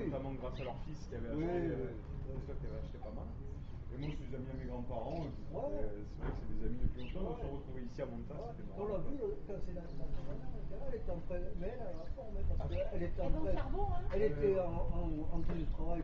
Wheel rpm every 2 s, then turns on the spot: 0, 0, 0, 0, 0, 0, 0, 0.
none